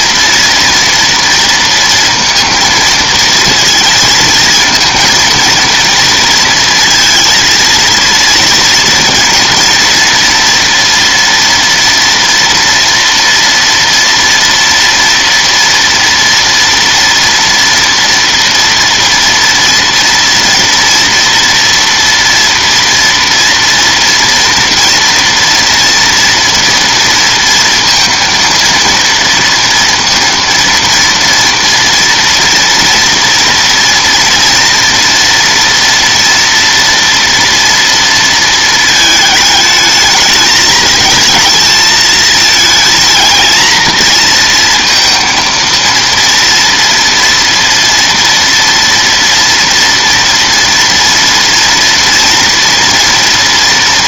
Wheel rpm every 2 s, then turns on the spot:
230, 230, 220, 230, 230, 230, 230, 230, 230, 230, 230, 230, 230, 230, 230, 230, 240, 230, 230, 220, 220, 220, 230, 230, 230, 230, 230.
none